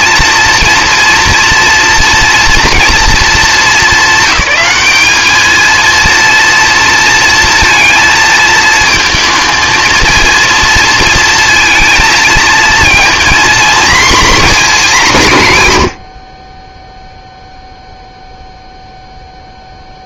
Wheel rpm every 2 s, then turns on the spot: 230, 230, 200, 230, 220, 230, 230, 230, 10, 0.
none